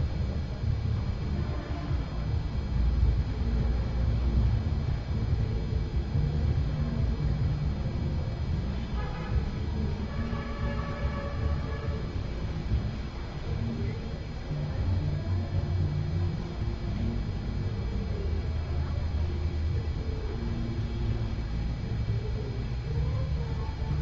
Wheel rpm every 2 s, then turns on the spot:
0, 0, 0, 0, 0, 0, 0, 0, 0, 0, 0, 0.
none